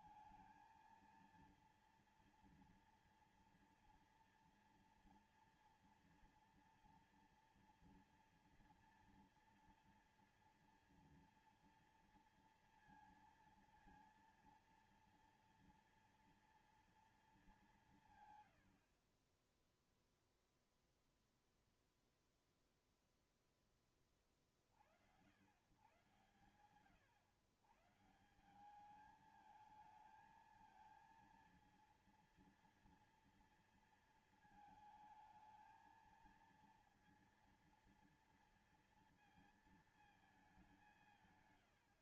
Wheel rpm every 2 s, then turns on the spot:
230, 240, 230, 230, 230, 230, 230, 230, 230, 140, 0, 0, 30, 120, 160, 220, 240, 230, 230, 230, 220.
none